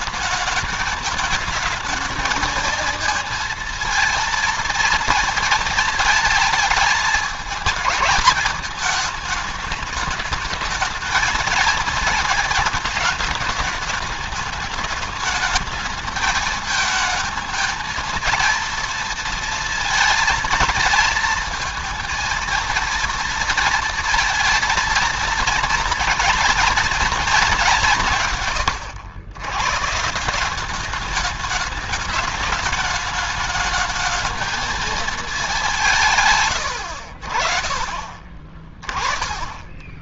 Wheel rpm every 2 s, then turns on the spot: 220, 230, 230, 220, 210, 220, 230, 210, 220, 230, 230, 230, 230, 230, 120, 190, 210, 220, 110, 40.
none